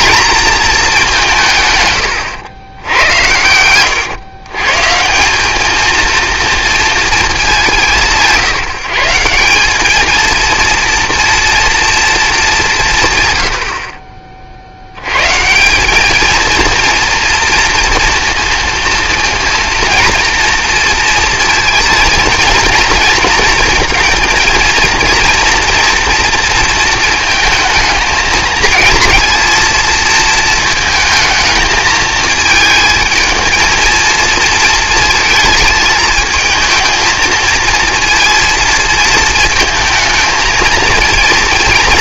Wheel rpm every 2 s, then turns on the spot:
210, 90, 140, 230, 170, 230, 190, 70, 230, 230, 230, 230, 230, 230, 230, 220, 220, 220, 220, 230, 220.
none